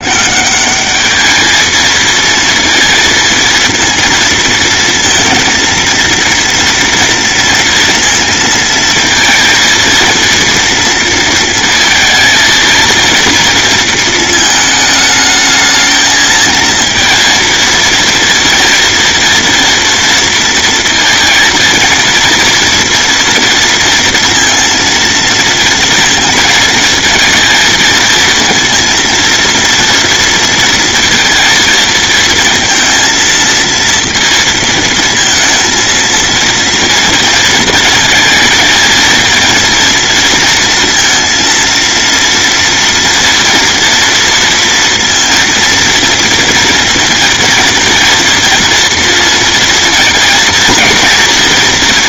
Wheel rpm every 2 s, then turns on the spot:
200, 230, 230, 230, 230, 230, 230, 220, 220, 230, 230, 230, 230, 230, 230, 230, 230, 230, 230, 230, 230, 240, 230, 230, 230, 230.
none